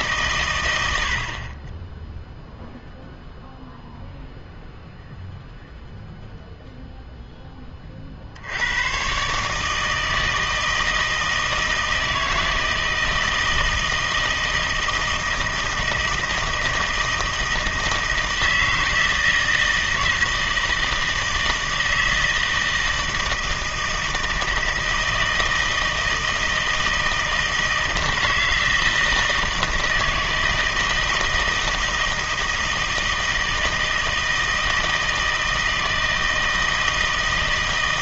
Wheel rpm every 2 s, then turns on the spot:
110, 0, 0, 0, 80, 160, 160, 160, 160, 160, 160, 160, 160, 160, 160, 160, 160, 160, 160.
none